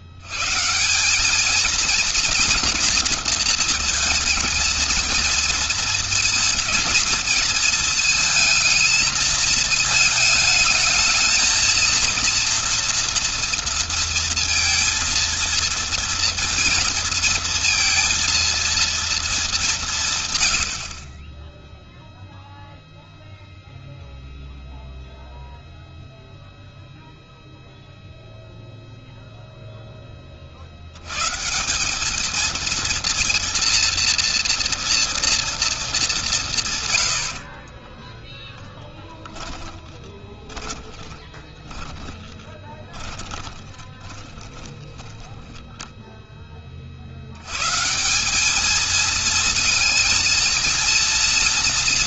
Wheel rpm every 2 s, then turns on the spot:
130, 240, 220, 220, 220, 220, 230, 230, 230, 230, 100, 0, 0, 0, 0, 50, 220, 230, 170, 20, 20, 30, 20, 20, 200, 230.
38-46